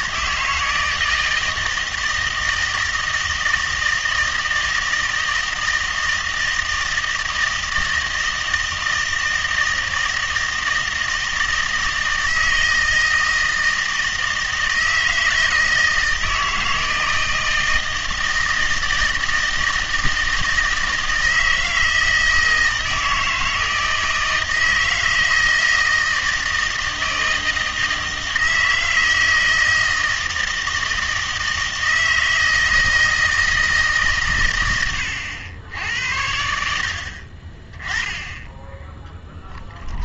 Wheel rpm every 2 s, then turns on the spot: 160, 160, 160, 160, 160, 160, 160, 160, 160, 160, 160, 160, 160, 160, 160, 160, 160, 110, 60, 10.
none